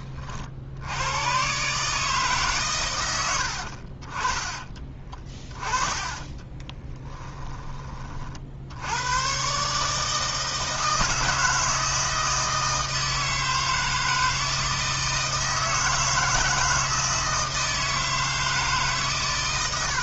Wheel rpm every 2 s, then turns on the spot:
80, 120, 20, 20, 70, 160, 160, 160, 160, 150.
4-8